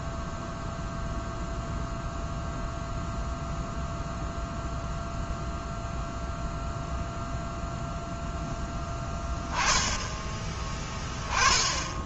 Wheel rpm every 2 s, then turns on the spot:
0, 0, 0, 0, 10, 20.
none